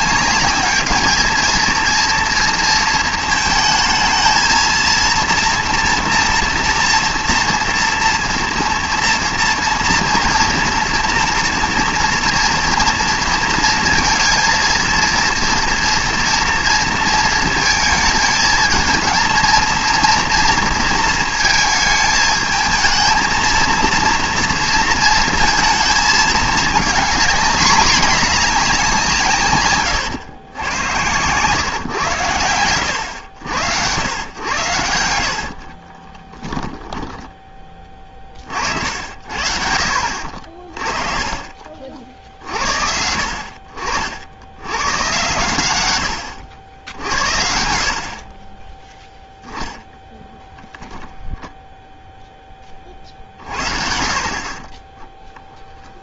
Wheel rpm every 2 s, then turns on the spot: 200, 230, 230, 230, 230, 230, 230, 230, 230, 220, 230, 220, 230, 220, 210, 100, 100, 90, 10, 50, 40, 60, 90, 90, 20, 0, 20, 30.
54-56